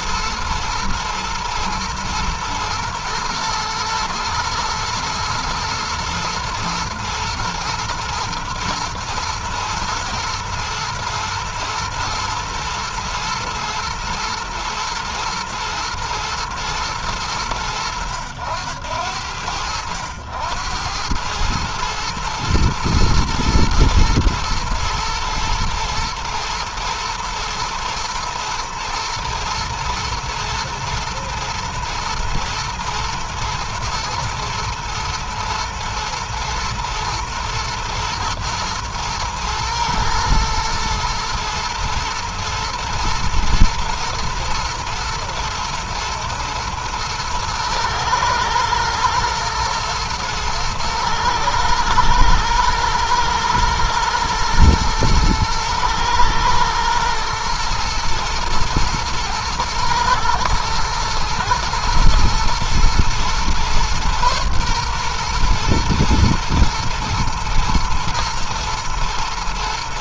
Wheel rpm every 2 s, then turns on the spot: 120, 120, 120, 120, 110, 120, 110, 110, 110, 80, 90, 110, 120, 120, 110, 120, 110, 120, 120, 120, 110, 110, 110, 110, 110, 110, 110, 120, 110, 120, 120, 110, 120, 110, 110.
none